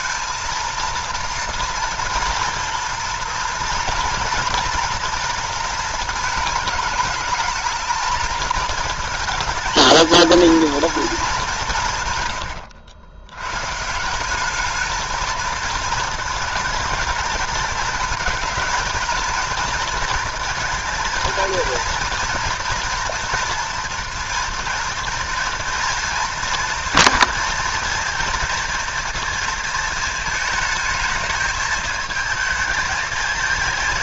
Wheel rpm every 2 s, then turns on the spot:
230, 230, 240, 220, 230, 230, 90, 210, 220, 220, 230, 230, 230, 230, 230, 220, 220.
12-14